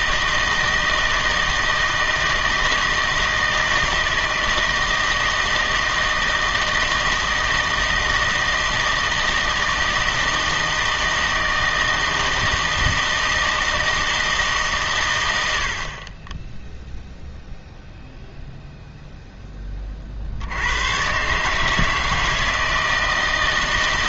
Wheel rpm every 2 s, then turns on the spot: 160, 160, 160, 160, 160, 160, 160, 140, 0, 0, 110, 160.
none